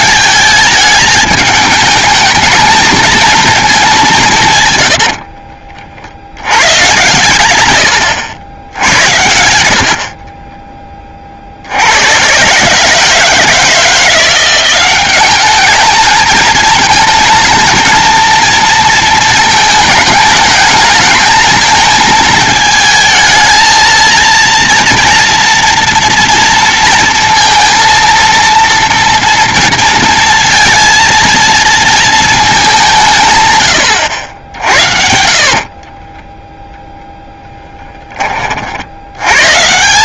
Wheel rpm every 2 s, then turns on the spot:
210, 220, 110, 110, 80, 20, 140, 190, 220, 230, 220, 220, 230, 230, 230, 230, 190, 60, 0, 60.
4-6 34-36